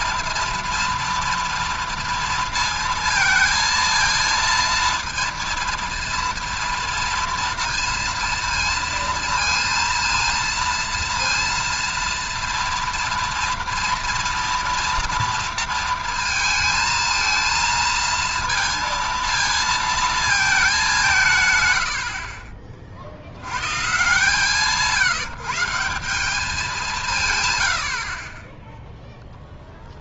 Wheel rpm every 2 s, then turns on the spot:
240, 230, 230, 230, 230, 230, 230, 230, 230, 230, 210, 40, 150, 200, 20.
none